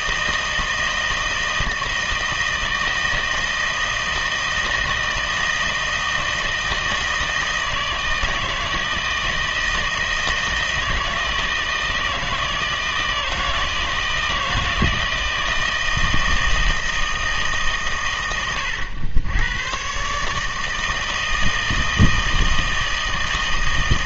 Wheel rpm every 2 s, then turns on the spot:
160, 160, 160, 160, 160, 160, 160, 160, 160, 100, 160, 160.
none